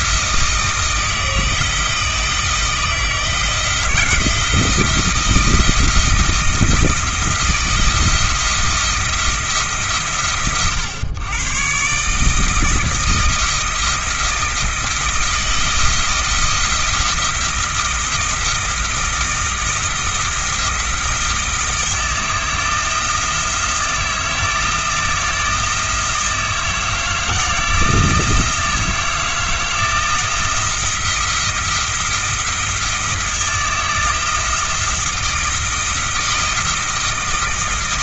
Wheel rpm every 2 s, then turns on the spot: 160, 160, 170, 170, 170, 110, 160, 170, 170, 160, 170, 170, 160, 160, 160, 170, 170, 170, 160.
none